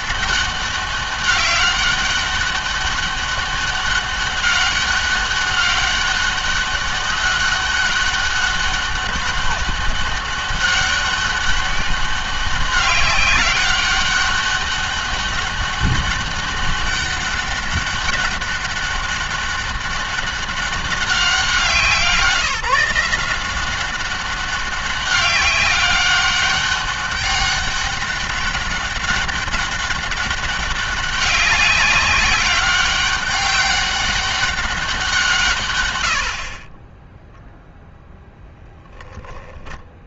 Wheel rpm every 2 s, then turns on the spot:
200, 200, 200, 200, 200, 200, 200, 200, 200, 200, 200, 170, 200, 200, 200, 200, 200, 180, 20, 0.
none